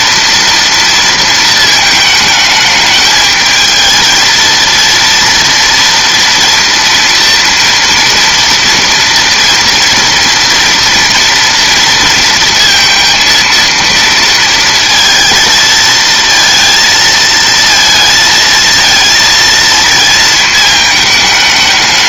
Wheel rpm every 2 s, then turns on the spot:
230, 210, 230, 230, 230, 240, 230, 230, 230, 220, 220.
none